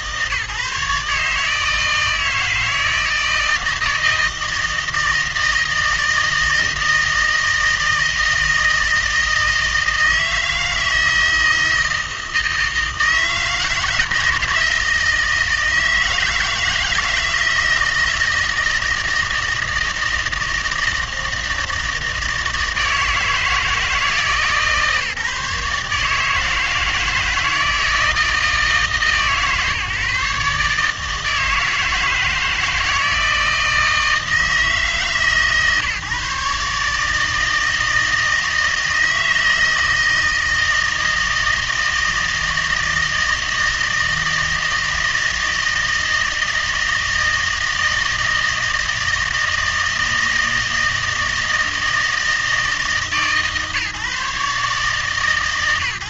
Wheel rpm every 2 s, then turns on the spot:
150, 160, 160, 160, 160, 160, 160, 160, 160, 160, 160, 160, 140, 160, 160, 150, 160, 160, 150, 160, 160, 160, 160, 160, 160, 160, 150, 130.
none